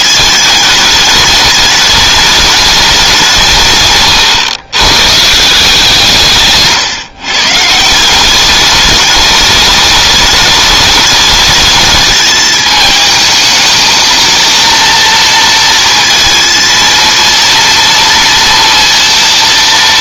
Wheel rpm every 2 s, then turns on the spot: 220, 210, 120, 160, 180, 210, 220, 220, 230, 230.
4-6